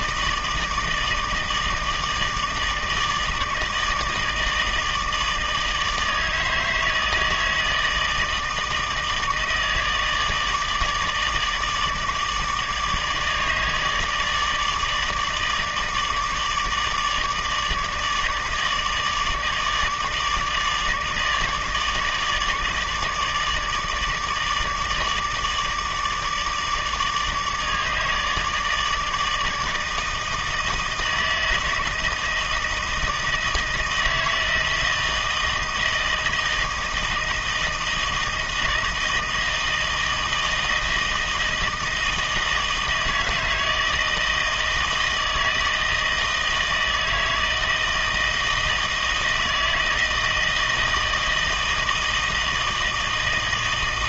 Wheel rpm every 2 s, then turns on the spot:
160, 160, 160, 160, 160, 160, 150, 150, 150, 160, 150, 160, 150, 150, 150, 160, 160, 160, 160, 160, 160, 160, 160, 160, 160, 160, 160.
none